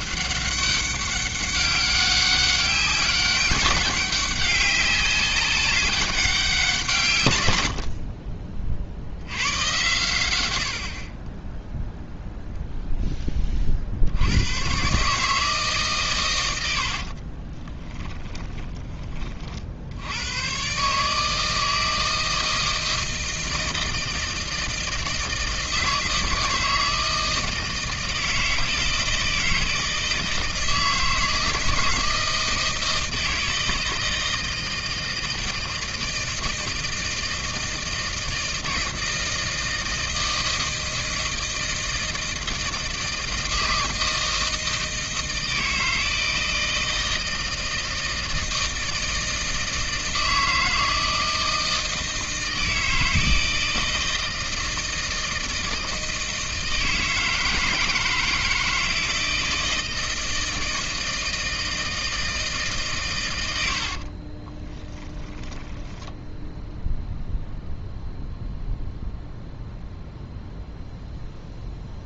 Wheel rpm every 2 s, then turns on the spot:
200, 190, 190, 160, 50, 70, 0, 130, 60, 20, 140, 160, 160, 160, 160, 160, 160, 160, 160, 160, 160, 160, 160, 160, 160, 160, 160, 160, 160, 160, 160, 140, 10, 0, 0, 0.
16-18 64-66